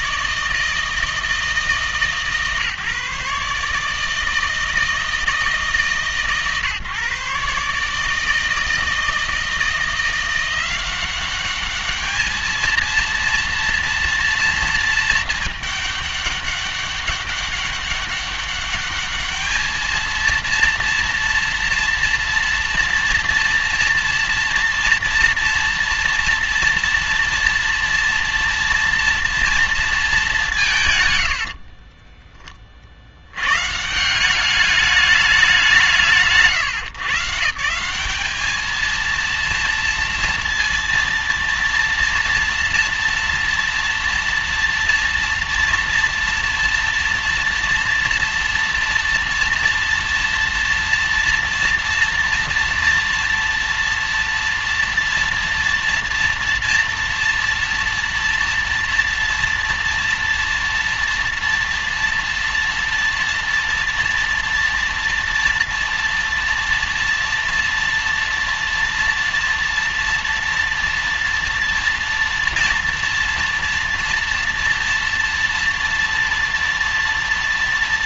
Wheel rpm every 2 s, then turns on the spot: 160, 150, 160, 150, 160, 180, 220, 230, 200, 200, 230, 240, 230, 230, 230, 160, 40, 210, 150, 220, 230, 230, 230, 230, 230, 230, 230, 230, 230, 230, 230, 230, 230, 230, 230, 230, 230, 230, 230.
none